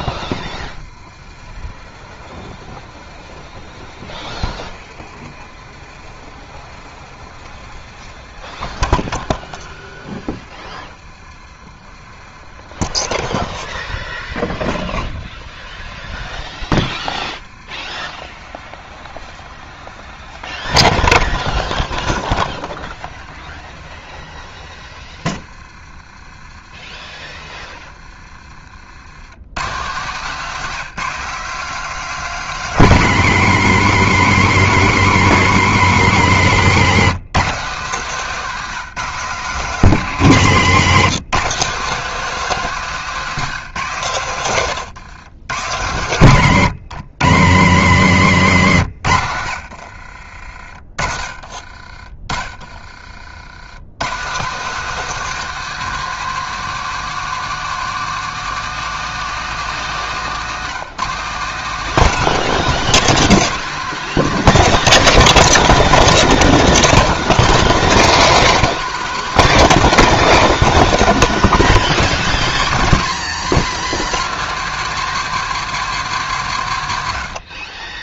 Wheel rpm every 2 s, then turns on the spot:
20, 40, 40, 30, 40, 40, 50, 30, 30, 30, 30, 40, 30, 30, 50, 190, 230, 210, 190, 210, 190, 220, 130, 150, 160, 50, 20, 200, 220, 230, 180, 230, 230, 220, 230, 220, 200, 210, 160.
2-14 20-24 48-52